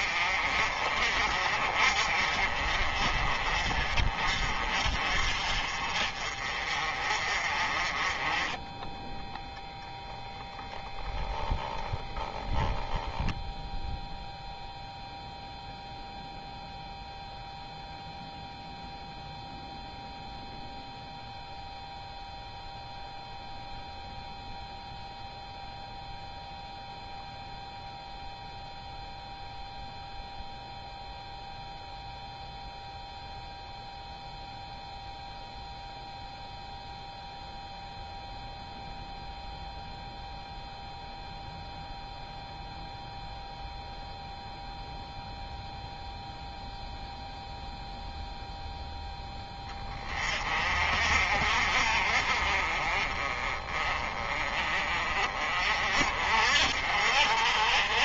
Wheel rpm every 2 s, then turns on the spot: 40, 40, 40, 40, 10, 0, 0, 0, 0, 0, 0, 0, 0, 0, 0, 0, 0, 0, 0, 0, 0, 0, 0, 0, 0, 40, 30, 30, 50.
none